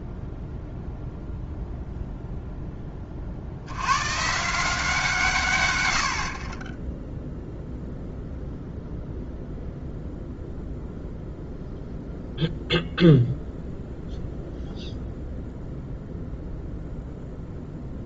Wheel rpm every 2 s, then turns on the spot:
0, 10, 160, 20, 0, 0, 0, 0, 0.
6-8